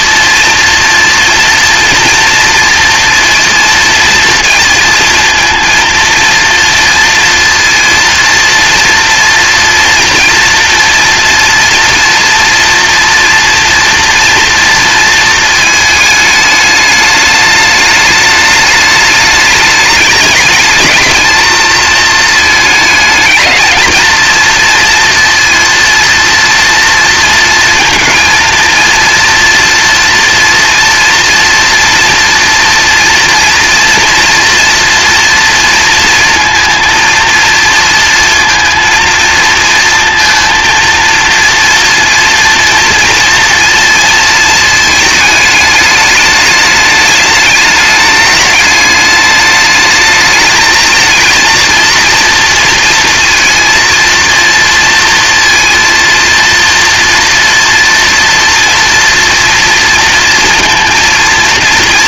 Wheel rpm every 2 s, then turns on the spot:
230, 240, 230, 230, 230, 230, 240, 230, 210, 210, 220, 220, 230, 230, 230, 230, 230, 230, 230, 230, 230, 240, 220, 210, 210, 220, 230, 230, 230, 230, 230.
none